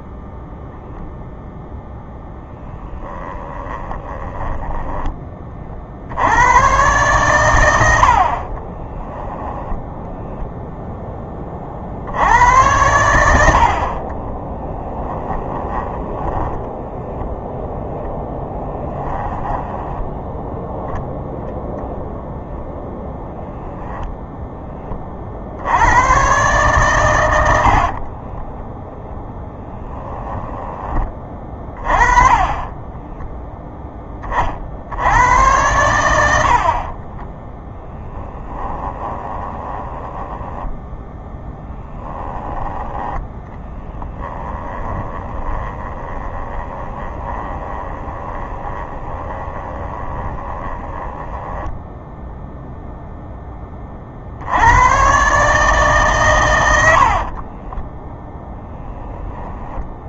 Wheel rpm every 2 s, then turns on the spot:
0, 10, 10, 120, 20, 10, 90, 10, 0, 10, 0, 0, 30, 120, 0, 20, 10, 60, 40, 20, 10, 10, 10, 20, 20, 10, 0, 100, 80, 0.
2-4 8-10 14-16 18-20 32-34 38-42 44-52 56-58